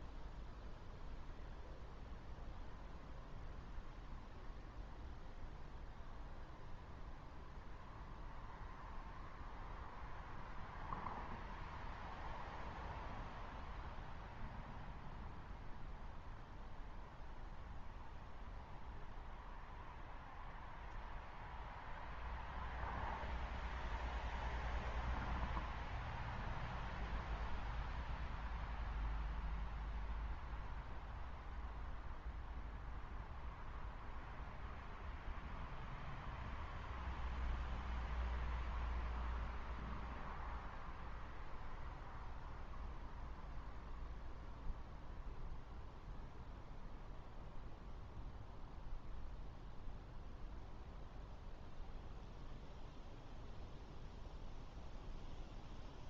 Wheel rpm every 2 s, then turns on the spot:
0, 0, 0, 0, 0, 0, 0, 0, 0, 0, 0, 0, 0, 0, 0, 0, 0, 0, 0, 0, 0, 0, 0, 0, 0, 0, 0, 0.
none